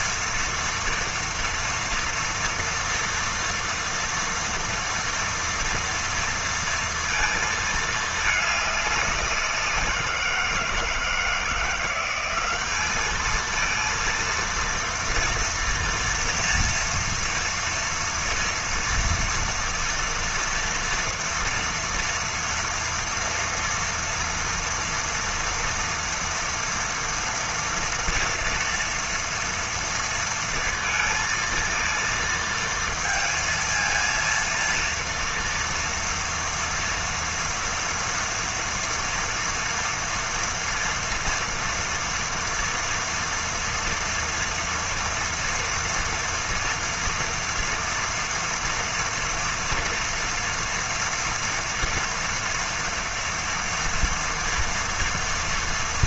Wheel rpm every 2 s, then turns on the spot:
240, 230, 230, 230, 200, 170, 210, 230, 230, 230, 230, 230, 230, 230, 230, 230, 230, 230, 230, 230, 240, 230, 230, 230, 240, 230, 230, 230.
none